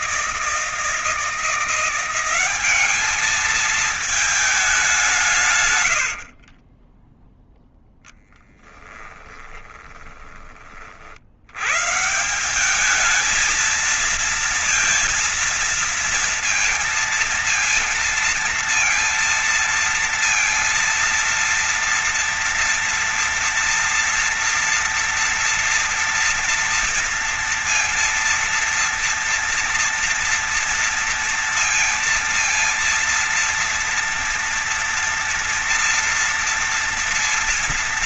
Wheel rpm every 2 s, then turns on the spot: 160, 190, 210, 60, 10, 20, 160, 230, 230, 230, 230, 230, 230, 230, 230, 230, 230, 230, 230.
6-10